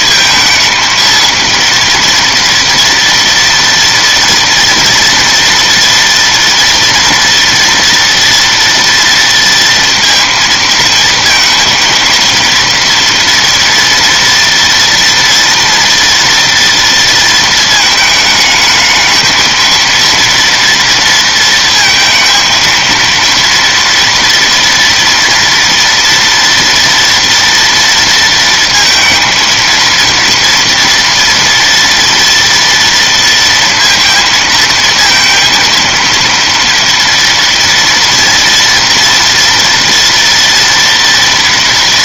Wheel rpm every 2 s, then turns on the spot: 230, 230, 240, 230, 230, 230, 230, 230, 230, 220, 230, 230, 230, 230, 230, 230, 230, 230, 230, 230, 230.
none